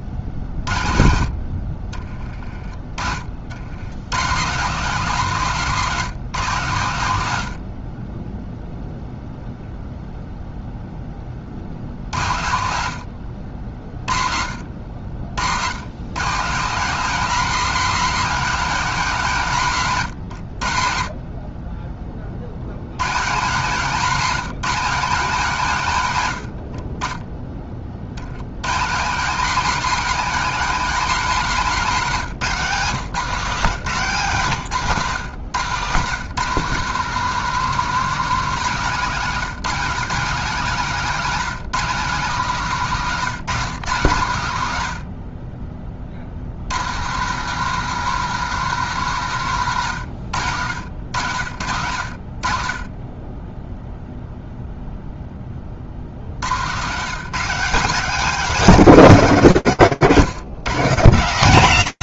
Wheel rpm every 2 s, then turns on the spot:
50, 20, 180, 130, 0, 0, 70, 60, 180, 210, 70, 100, 180, 60, 140, 230, 150, 130, 190, 180, 200, 170, 130, 140, 190, 90, 40, 0, 130, 230, 190.
0-2 12-14 26-28